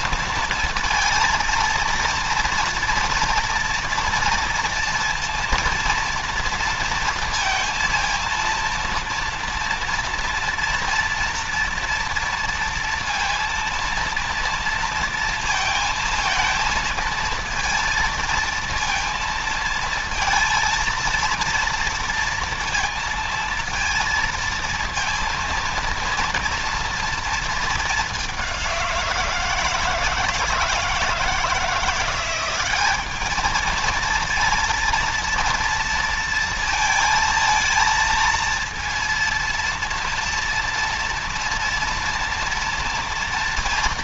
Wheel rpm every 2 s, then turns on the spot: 230, 230, 230, 230, 230, 230, 230, 230, 230, 230, 230, 230, 230, 230, 190, 160, 180, 230, 230, 230, 230, 230.
none